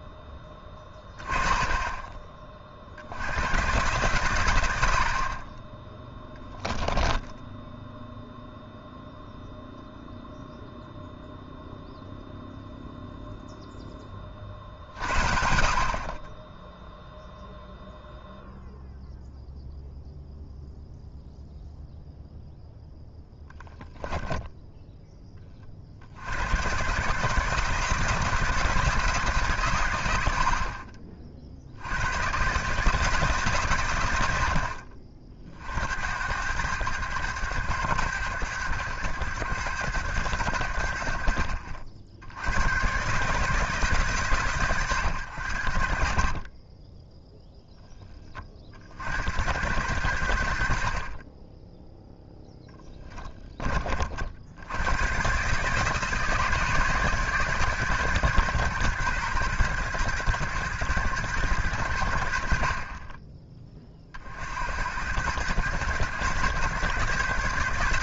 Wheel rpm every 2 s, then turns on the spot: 10, 50, 100, 10, 0, 0, 0, 50, 0, 0, 0, 0, 10, 120, 160, 50, 140, 60, 100, 100, 80, 110, 120, 20, 60, 60, 10, 100, 150, 130, 120, 50, 70, 130.
6-8 24-26 46-48 50-54